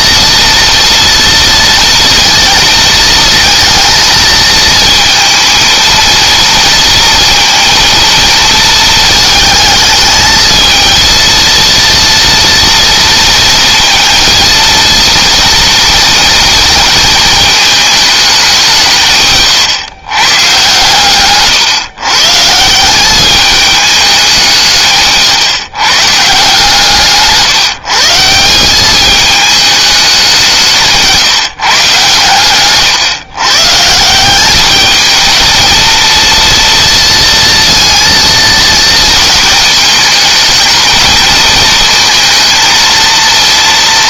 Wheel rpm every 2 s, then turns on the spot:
230, 230, 230, 230, 220, 230, 230, 230, 220, 150, 140, 200, 150, 150, 210, 150, 130, 220, 230, 220, 220, 220.
26-28